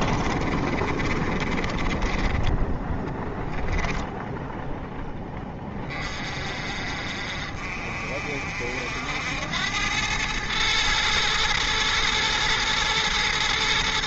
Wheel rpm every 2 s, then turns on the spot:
30, 10, 10, 50, 70, 110, 110.
0-4